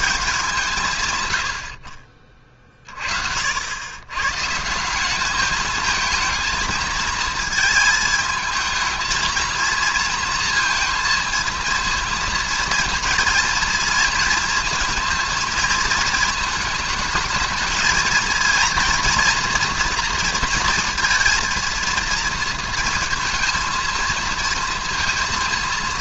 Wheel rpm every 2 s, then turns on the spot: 170, 40, 150, 220, 220, 230, 230, 230, 220, 230, 230, 230, 230.
none